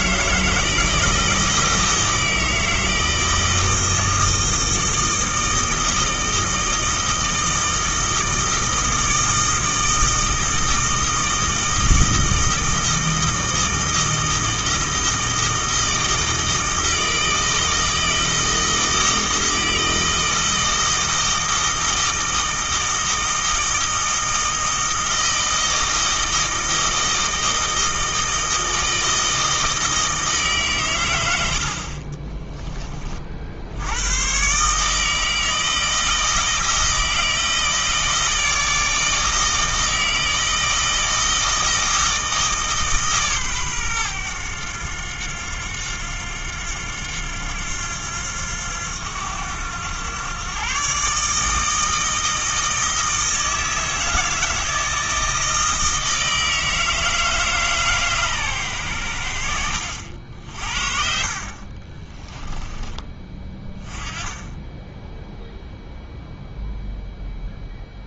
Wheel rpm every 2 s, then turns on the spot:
160, 160, 160, 160, 160, 160, 160, 160, 160, 160, 160, 160, 160, 160, 160, 140, 20, 140, 160, 160, 160, 150, 100, 90, 90, 120, 160, 160, 160, 120, 50, 10, 10, 0.
62-64